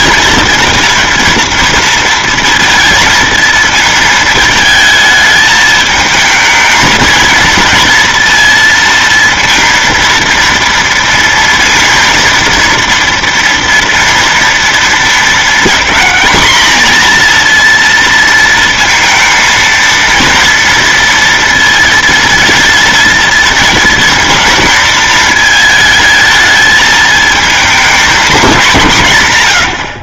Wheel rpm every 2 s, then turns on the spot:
230, 230, 220, 220, 230, 230, 230, 230, 230, 230, 230, 230, 220, 220, 180.
none